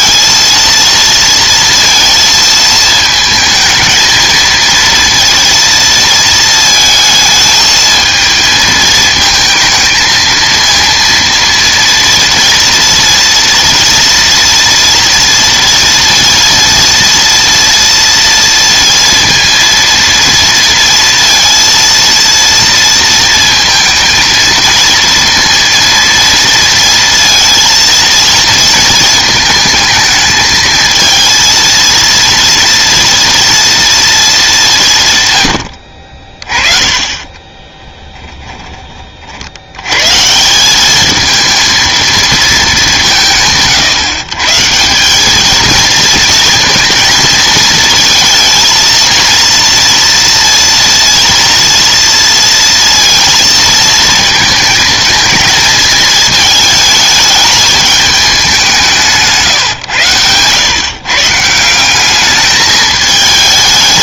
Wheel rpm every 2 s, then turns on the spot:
230, 220, 230, 220, 220, 230, 230, 230, 230, 230, 230, 230, 230, 230, 230, 220, 230, 200, 30, 20, 180, 210, 150, 230, 230, 230, 230, 230, 220, 190, 120, 210.
none